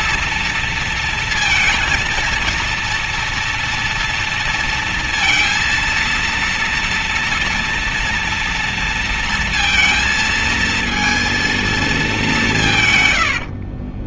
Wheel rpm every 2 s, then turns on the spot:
230, 230, 230, 230, 230, 230, 110.
12-14